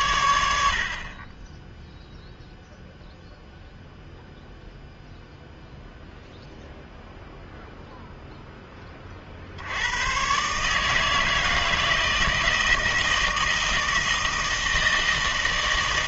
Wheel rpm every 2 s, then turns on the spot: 90, 0, 0, 0, 10, 150, 160, 160.
none